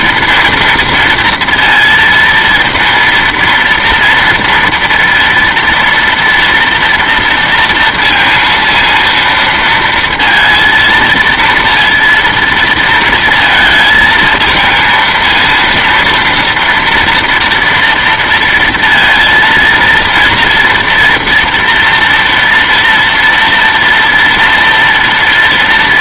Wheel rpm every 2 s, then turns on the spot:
230, 230, 230, 240, 230, 230, 230, 230, 230, 230, 230, 230, 230.
none